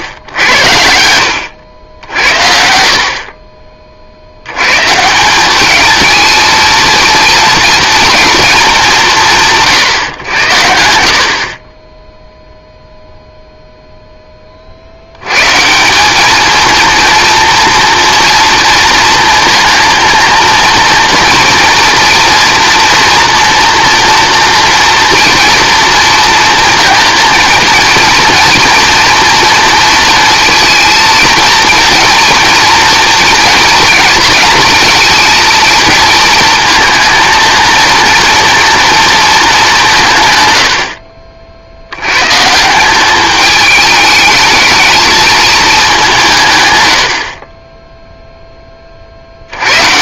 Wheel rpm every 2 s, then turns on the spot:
80, 70, 120, 230, 170, 80, 0, 60, 230, 230, 230, 240, 230, 230, 230, 230, 230, 230, 230, 240, 70, 180, 220, 90, 40.
none